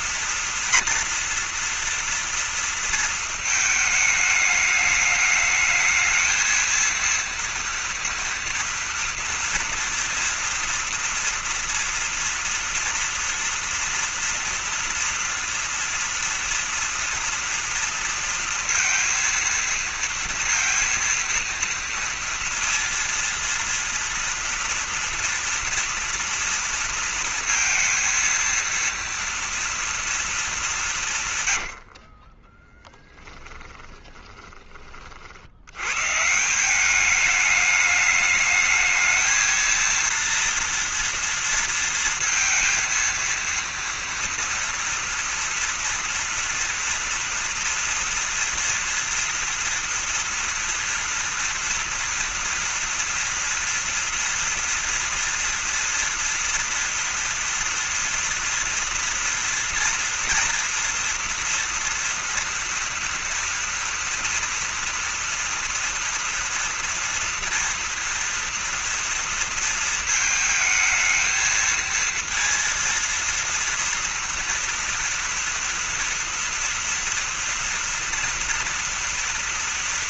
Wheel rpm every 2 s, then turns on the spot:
240, 230, 210, 220, 230, 230, 230, 230, 230, 230, 230, 230, 230, 230, 230, 220, 30, 20, 160, 210, 230, 230, 230, 230, 230, 230, 230, 230, 230, 230, 230, 230, 230, 230, 230, 230, 230, 230, 230, 230.
32-36